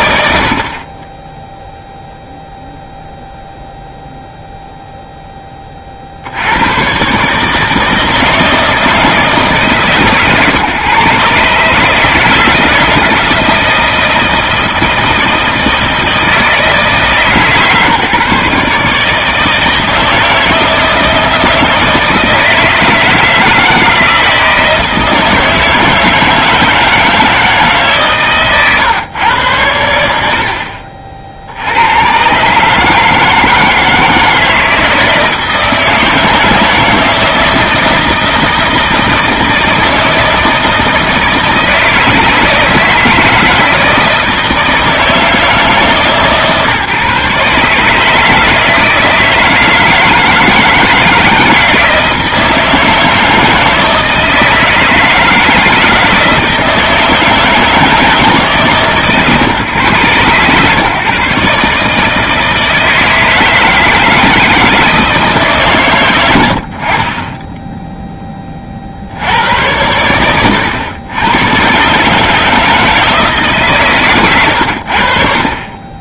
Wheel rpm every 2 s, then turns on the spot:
70, 0, 0, 100, 160, 130, 160, 160, 160, 150, 160, 160, 160, 160, 120, 40, 150, 160, 160, 160, 160, 160, 160, 150, 160, 160, 160, 160, 160, 130, 130, 160, 160, 20, 50, 120, 160, 80.
none